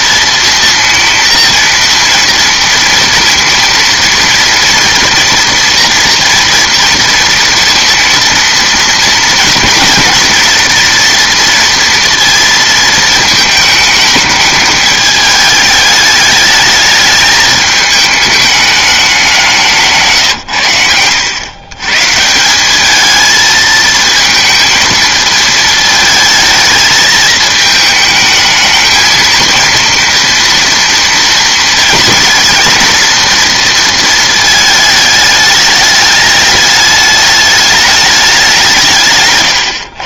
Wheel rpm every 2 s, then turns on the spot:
230, 230, 230, 230, 230, 230, 230, 210, 210, 210, 90, 190, 220, 220, 220, 230, 230, 220, 210, 180.
none